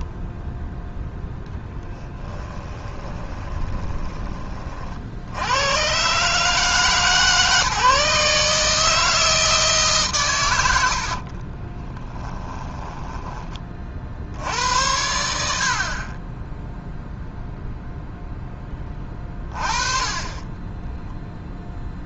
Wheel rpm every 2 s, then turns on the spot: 0, 20, 50, 150, 160, 70, 10, 90, 0, 20, 10.
2-4 10-14 20-22